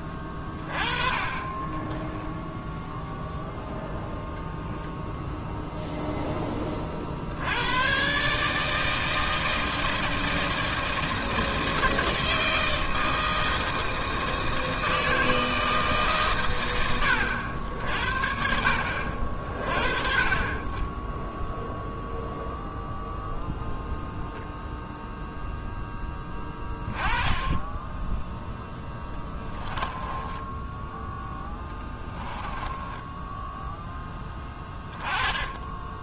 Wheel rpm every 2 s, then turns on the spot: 20, 0, 0, 30, 150, 160, 160, 160, 100, 60, 20, 0, 0, 20, 10, 10, 10, 10.
28-34